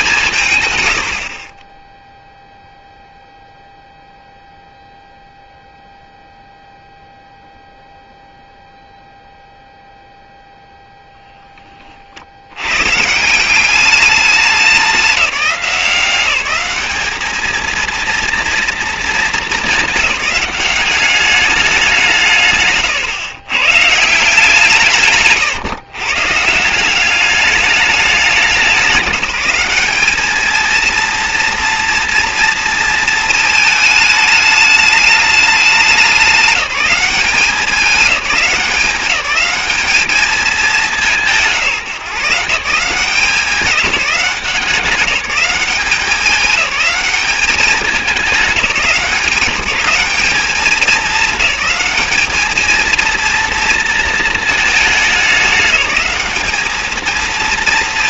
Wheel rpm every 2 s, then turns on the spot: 130, 0, 0, 0, 0, 0, 90, 200, 200, 230, 200, 130, 170, 170, 190, 220, 230, 220, 190, 190, 200, 160, 190, 200, 190, 210, 220, 220, 210.
none